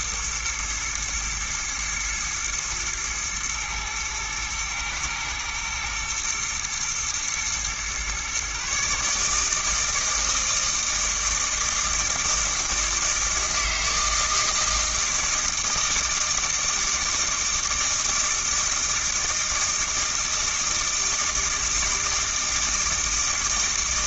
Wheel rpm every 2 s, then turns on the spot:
110, 120, 110, 120, 140, 160, 160, 160, 160, 160, 160, 160.
none